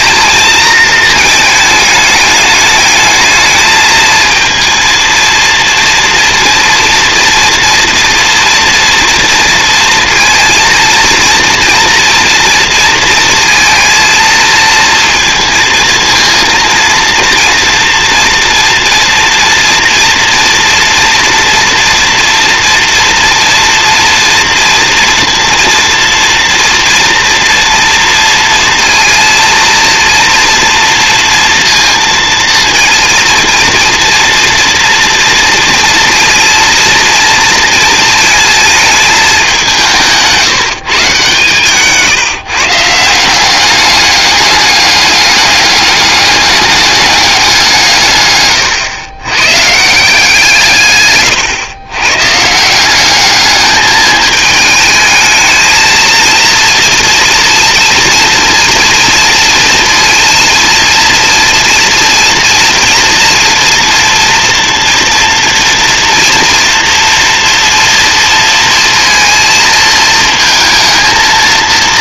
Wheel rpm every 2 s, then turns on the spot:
220, 210, 230, 230, 230, 230, 230, 230, 230, 230, 230, 230, 230, 230, 230, 230, 230, 230, 230, 220, 150, 160, 200, 200, 120, 130, 180, 210, 230, 230, 230, 230, 230, 230, 230, 220.
50-52